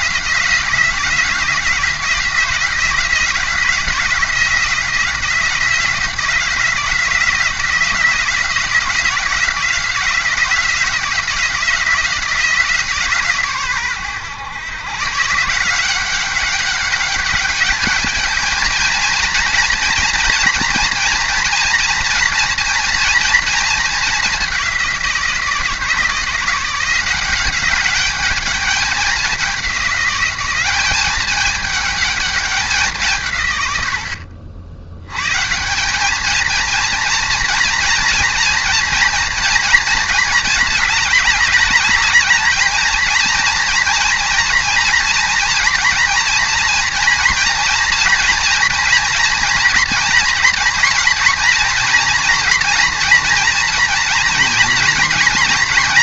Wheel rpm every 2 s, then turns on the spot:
170, 170, 170, 170, 170, 170, 170, 120, 190, 220, 230, 230, 210, 170, 200, 190, 210, 70, 220, 230, 210, 210, 240, 230, 230, 240, 230, 230.
none